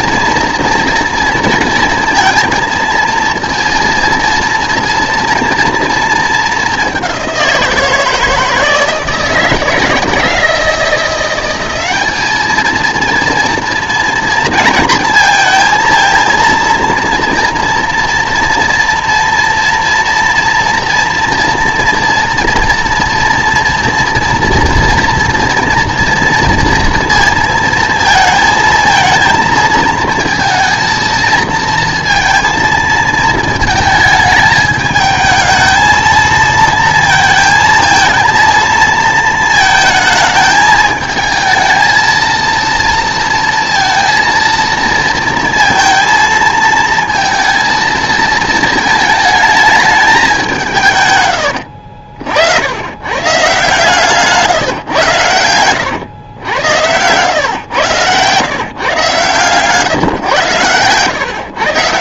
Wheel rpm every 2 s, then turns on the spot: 230, 230, 230, 200, 160, 170, 220, 230, 230, 230, 230, 230, 230, 230, 220, 230, 230, 220, 230, 230, 220, 230, 230, 230, 220, 160, 80, 140, 110, 150, 120.
none